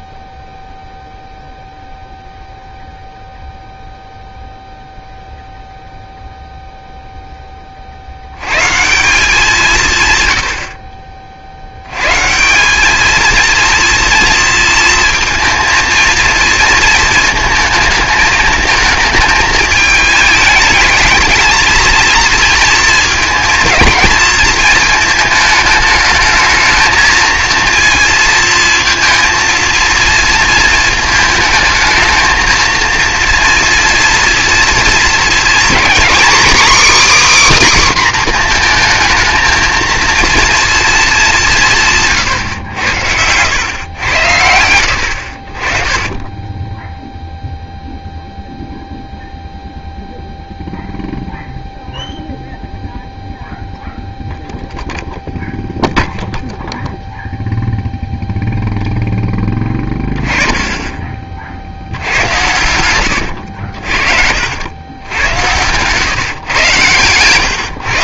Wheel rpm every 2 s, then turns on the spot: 0, 0, 0, 0, 160, 50, 190, 230, 230, 220, 220, 230, 220, 220, 230, 220, 220, 230, 290, 240, 230, 90, 90, 10, 0, 0, 0, 0, 0, 0, 20, 100, 90, 110.
none